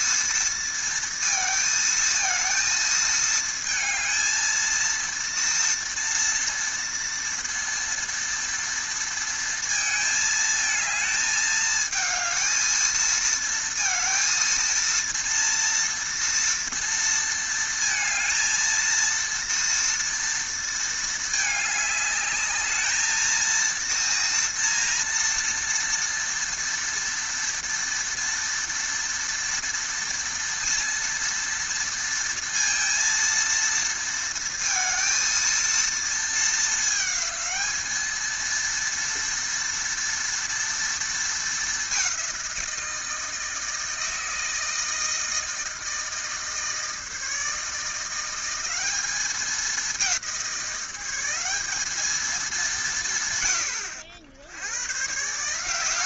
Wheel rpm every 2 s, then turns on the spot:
230, 220, 230, 230, 230, 220, 220, 230, 230, 230, 230, 220, 230, 240, 230, 230, 230, 230, 220, 230, 230, 170, 160, 160, 190, 180, 170, 110.
none